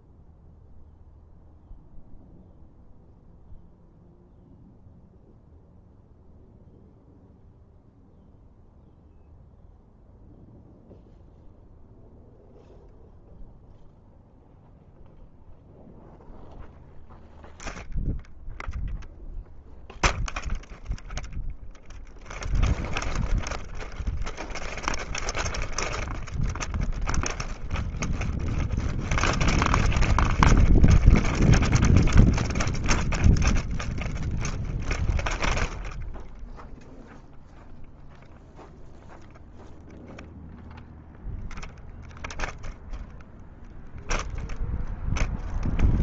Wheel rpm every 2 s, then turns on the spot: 0, 0, 0, 0, 0, 0, 0, 0, 0, 0, 0, 0, 0, 0, 0, 0, 0, 0, 0, 0, 0, 0, 0.
none